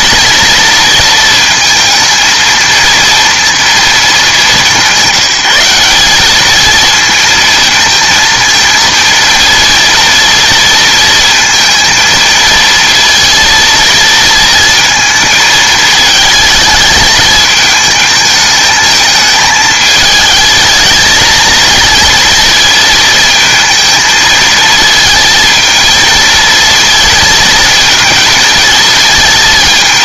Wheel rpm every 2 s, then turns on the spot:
230, 230, 180, 220, 230, 230, 220, 230, 220, 220, 220, 220, 230, 220, 230.
none